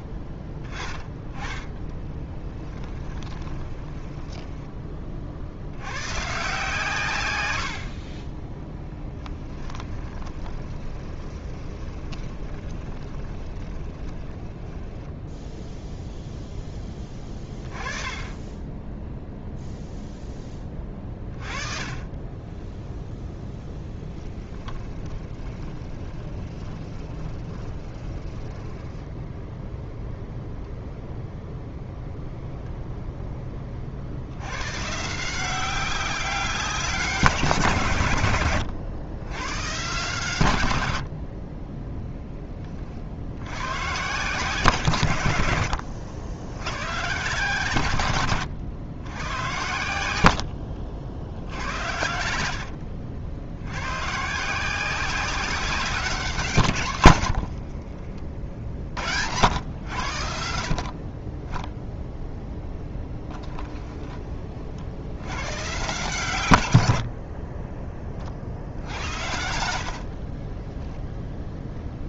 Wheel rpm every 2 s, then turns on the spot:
20, 10, 20, 140, 10, 20, 20, 20, 10, 10, 20, 0, 10, 20, 10, 0, 0, 130, 180, 90, 100, 20, 130, 110, 100, 60, 70, 180, 120, 50, 60, 0, 50, 80, 70, 10.
2-4 8-16 24-30 50-54 70-72